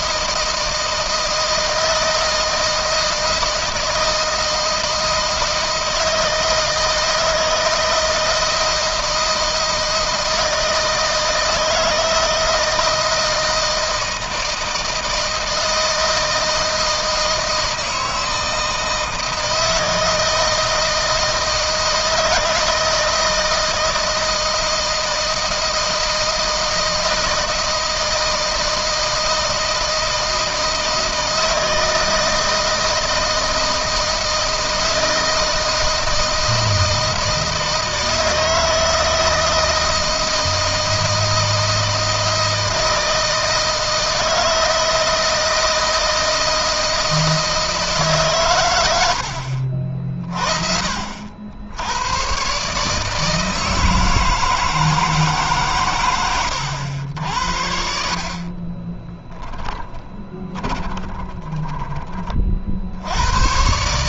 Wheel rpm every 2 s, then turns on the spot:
160, 160, 160, 160, 160, 160, 160, 160, 160, 160, 160, 160, 160, 160, 160, 160, 160, 160, 160, 160, 160, 160, 160, 160, 100, 70, 150, 160, 80, 30, 20, 70.
58-62